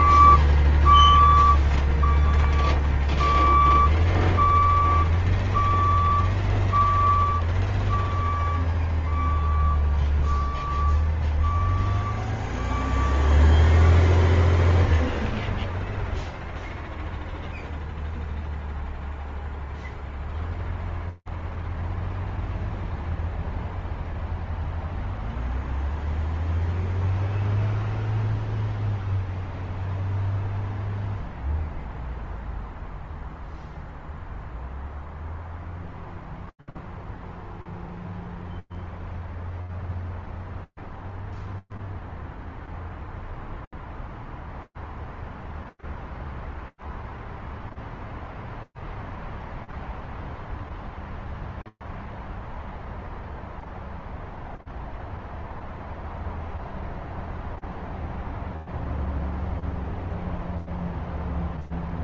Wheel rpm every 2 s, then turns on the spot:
0, 0, 0, 0, 0, 0, 0, 0, 0, 0, 0, 0, 0, 0, 0, 0, 0, 0, 0, 0, 0, 0, 0, 0, 0, 0, 0, 0, 0, 0, 0.
none